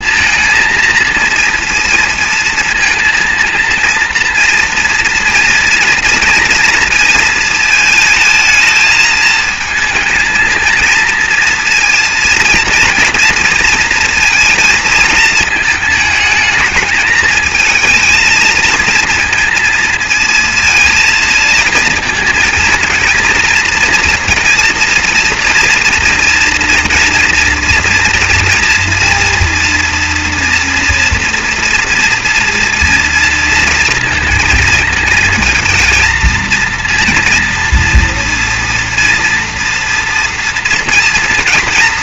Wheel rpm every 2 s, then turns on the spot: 230, 230, 230, 230, 220, 220, 230, 230, 220, 220, 230, 230, 230, 240, 230, 230, 230, 230, 230, 240, 240.
none